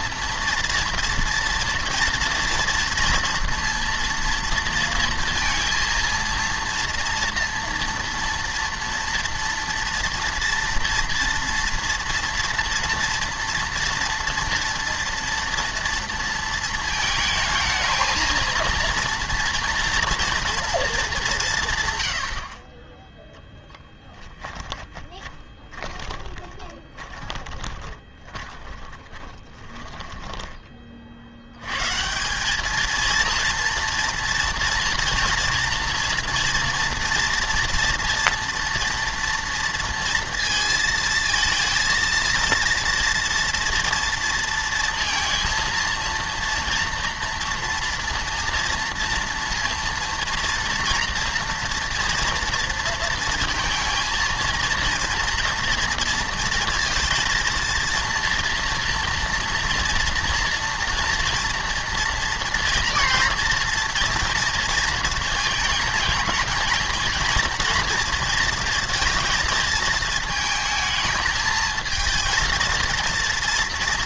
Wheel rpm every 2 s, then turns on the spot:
230, 230, 230, 230, 230, 230, 230, 230, 230, 230, 230, 30, 20, 20, 20, 30, 210, 230, 230, 230, 230, 230, 230, 240, 230, 230, 230, 230, 230, 230, 230, 230, 230, 220, 230, 220, 230.
24-30